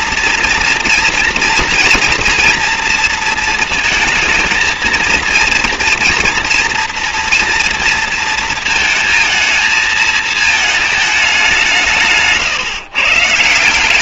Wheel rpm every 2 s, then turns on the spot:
230, 230, 230, 230, 230, 220, 150.
none